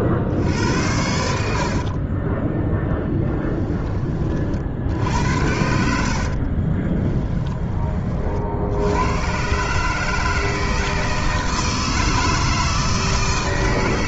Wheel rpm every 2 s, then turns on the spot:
80, 10, 60, 30, 80, 160, 160.
6-8